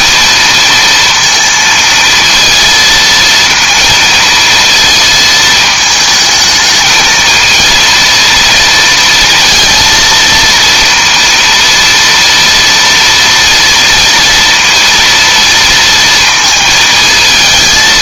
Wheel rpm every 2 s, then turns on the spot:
230, 230, 230, 220, 230, 230, 230, 230, 220.
none